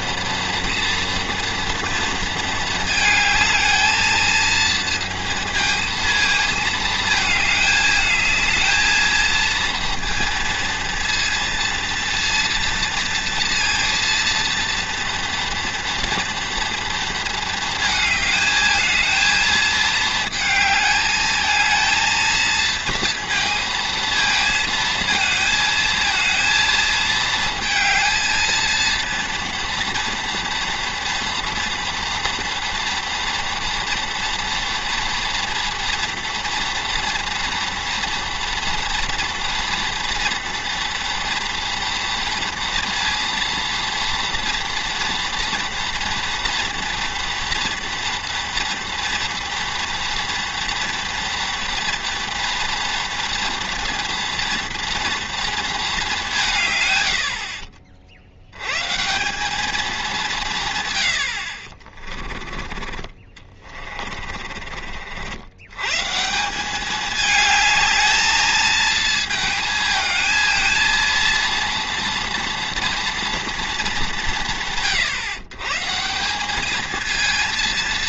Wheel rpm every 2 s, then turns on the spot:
240, 220, 230, 220, 220, 230, 230, 230, 230, 220, 220, 230, 220, 220, 230, 240, 230, 230, 230, 230, 240, 230, 230, 240, 230, 230, 240, 230, 120, 140, 120, 30, 50, 200, 220, 230, 230, 150, 220.
none